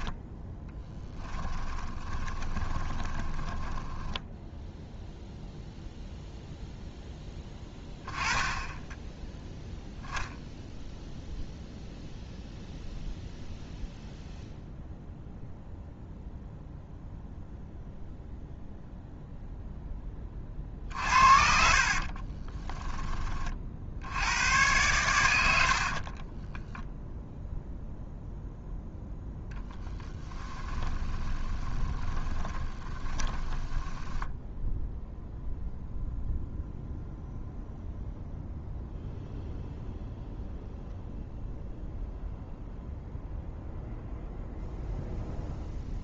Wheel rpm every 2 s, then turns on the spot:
10, 30, 0, 0, 10, 0, 0, 0, 0, 0, 50, 10, 110, 0, 0, 20, 20, 0, 0, 0, 0, 0, 0.
0-4 20-22 30-34